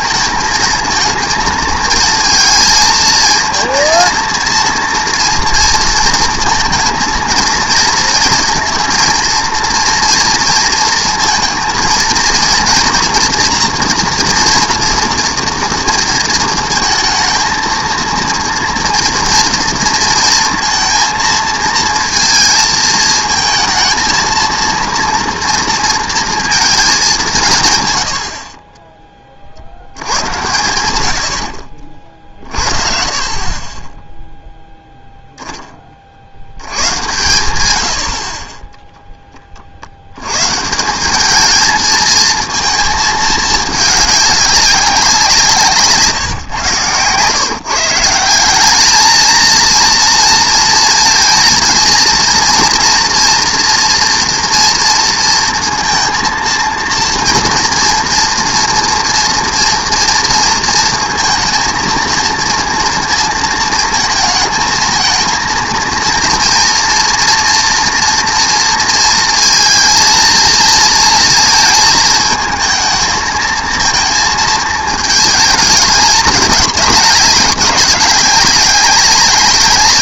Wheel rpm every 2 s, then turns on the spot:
220, 230, 230, 230, 230, 230, 230, 230, 230, 230, 230, 220, 230, 220, 20, 110, 50, 0, 100, 20, 170, 230, 200, 130, 200, 230, 230, 230, 230, 240, 230, 230, 220, 230, 230, 230, 220, 220, 200, 190.
none